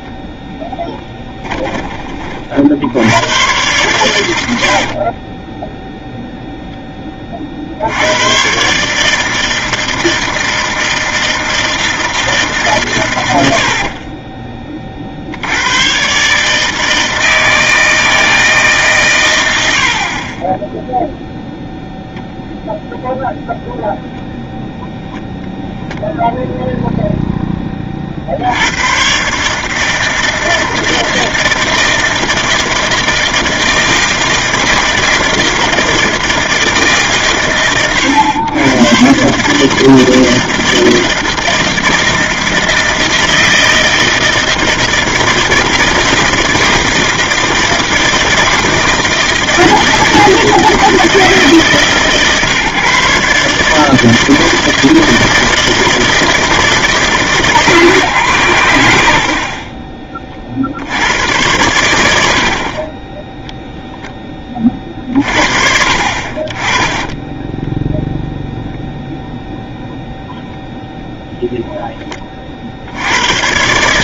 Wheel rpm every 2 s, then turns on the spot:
10, 50, 90, 0, 130, 160, 140, 30, 150, 150, 10, 0, 0, 0, 80, 160, 160, 160, 160, 100, 160, 160, 160, 160, 160, 160, 140, 160, 160, 130, 40, 60, 20, 40, 0, 0, 50.
none